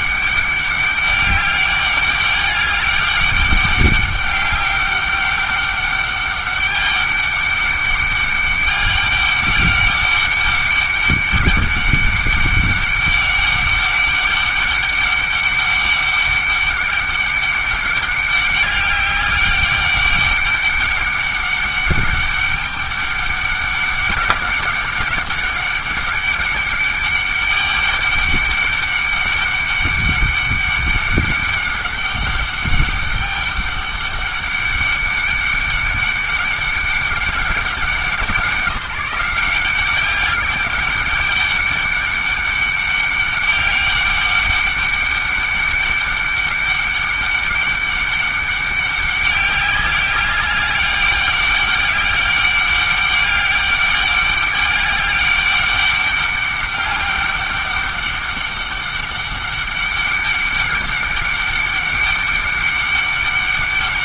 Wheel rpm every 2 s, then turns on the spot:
200, 200, 200, 200, 200, 200, 200, 200, 200, 200, 200, 200, 200, 200, 200, 200, 200, 200, 200, 180, 200, 200, 200, 200, 200, 200, 200, 200, 200, 200, 200, 200.
none